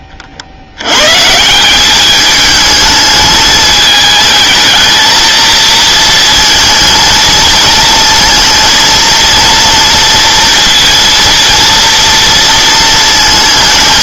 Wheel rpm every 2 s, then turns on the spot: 60, 210, 220, 230, 230, 230, 230.
none